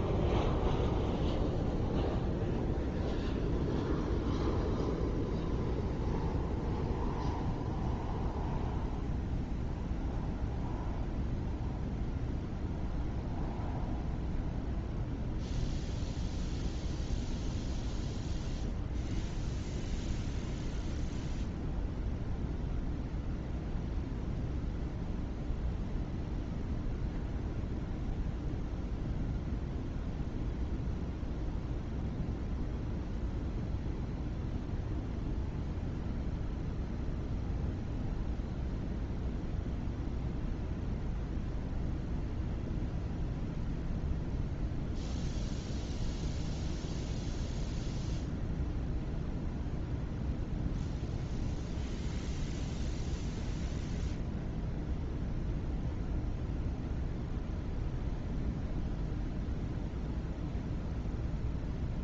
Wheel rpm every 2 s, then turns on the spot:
0, 0, 0, 0, 0, 0, 0, 0, 0, 0, 0, 0, 0, 0, 0, 0, 0, 0, 0, 0, 0, 0, 0, 0, 0, 0, 0, 0, 0, 0, 0.
none